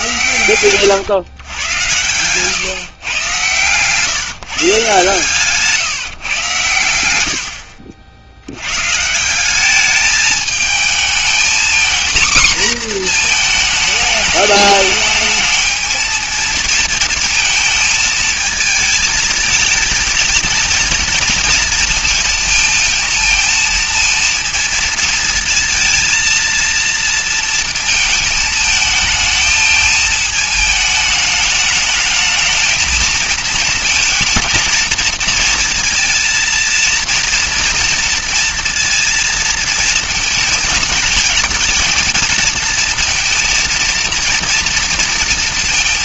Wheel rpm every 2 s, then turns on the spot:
120, 130, 150, 110, 100, 220, 240, 210, 230, 220, 220, 220, 230, 230, 220, 220, 220, 230, 230, 230, 220, 230, 230.
0-2